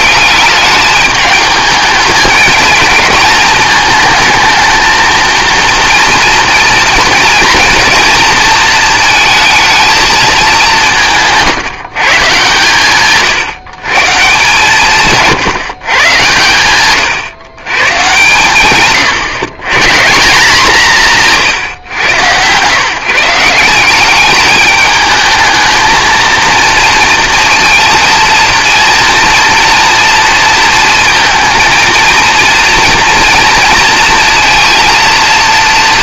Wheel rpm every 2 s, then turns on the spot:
210, 220, 220, 230, 220, 170, 140, 160, 120, 130, 180, 150, 210, 230, 230, 230, 230, 230.
none